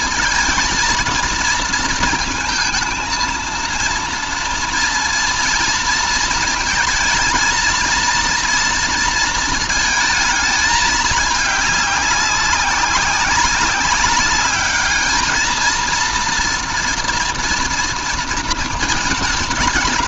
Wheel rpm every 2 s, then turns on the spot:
230, 230, 230, 230, 230, 210, 190, 210, 230, 200.
none